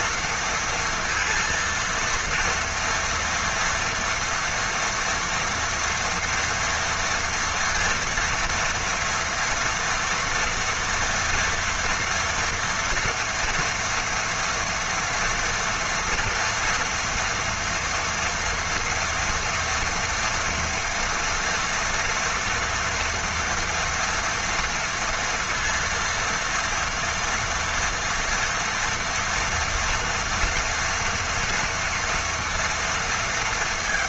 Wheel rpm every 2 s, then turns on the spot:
230, 230, 230, 230, 230, 230, 230, 230, 230, 240, 230, 230, 230, 230, 230, 230, 230.
none